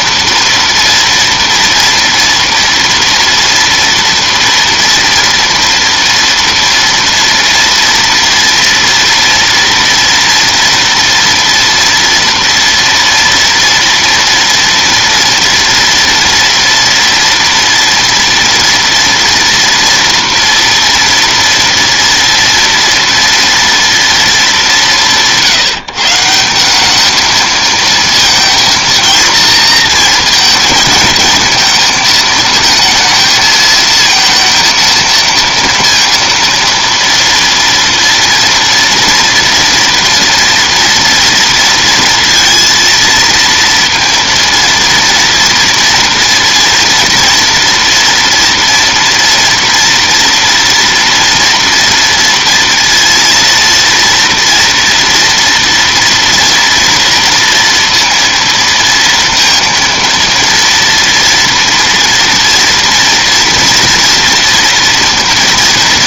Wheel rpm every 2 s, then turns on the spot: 230, 230, 230, 230, 230, 240, 240, 230, 230, 230, 230, 230, 160, 200, 230, 230, 230, 230, 230, 230, 230, 230, 230, 230, 230, 230, 230, 230, 230, 230, 230, 230, 230.
none